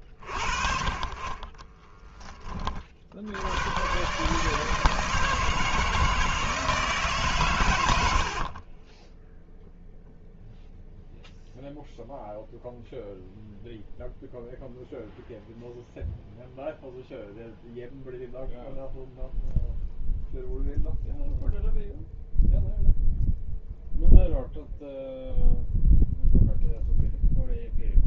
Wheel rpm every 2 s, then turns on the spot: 40, 60, 160, 130, 10, 0, 0, 0, 0, 0, 0, 0, 0, 0.
8-10